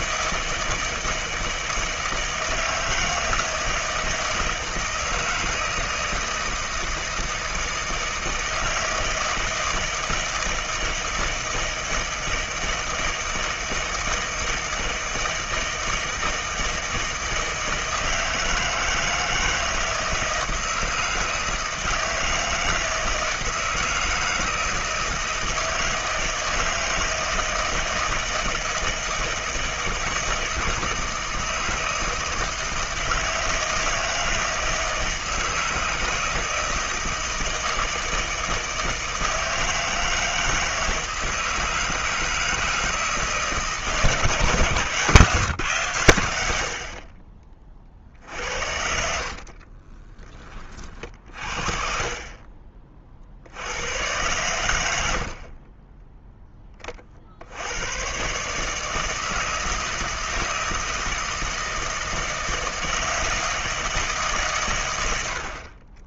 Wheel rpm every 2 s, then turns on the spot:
160, 160, 160, 160, 160, 160, 160, 160, 160, 160, 160, 160, 160, 160, 160, 160, 160, 160, 160, 160, 160, 160, 150, 80, 60, 30, 40, 90, 20, 150, 160, 160, 130.
48-50 54-56